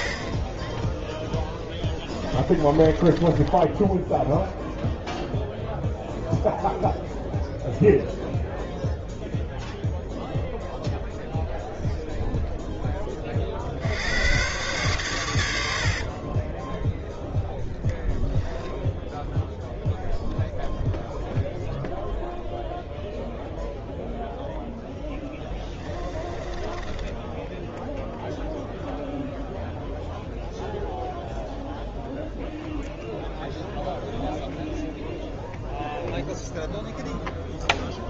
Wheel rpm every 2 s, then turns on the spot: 20, 20, 0, 0, 0, 0, 0, 120, 10, 0, 0, 0, 0, 20, 0, 0, 0, 0, 0.
2-4 16-18 26-28